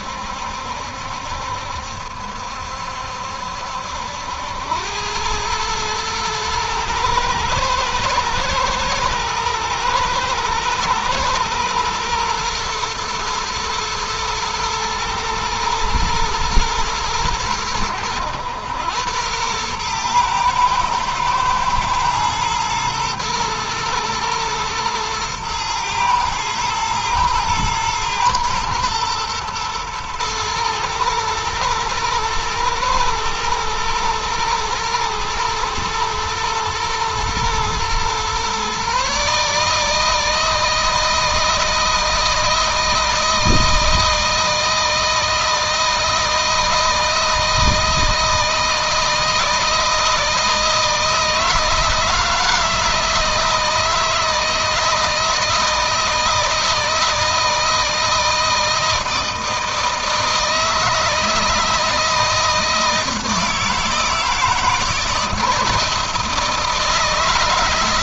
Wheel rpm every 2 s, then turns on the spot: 70, 70, 90, 110, 120, 120, 120, 110, 110, 100, 120, 120, 110, 110, 120, 110, 110, 110, 110, 130, 160, 160, 160, 160, 160, 160, 160, 160, 160, 160, 160, 160, 160, 160.
none